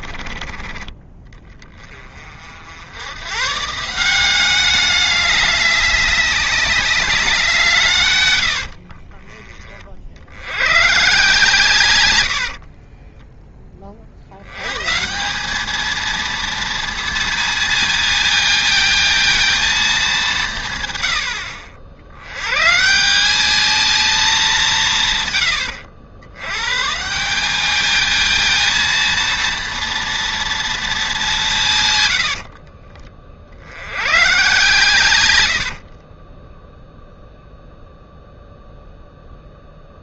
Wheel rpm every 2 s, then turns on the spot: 30, 70, 200, 200, 70, 110, 40, 110, 230, 220, 150, 130, 180, 100, 230, 230, 40, 120, 0, 0.
8-10 12-14 32-34